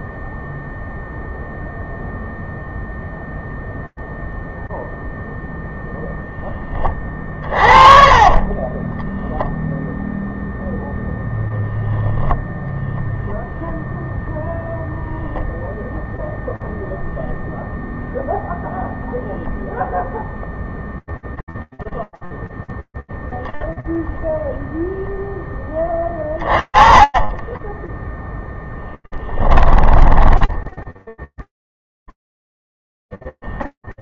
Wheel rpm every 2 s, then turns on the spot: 0, 0, 0, 40, 10, 10, 10, 0, 0, 0, 0, 0, 10, 10, 10, 0, 0.
8-10 28-30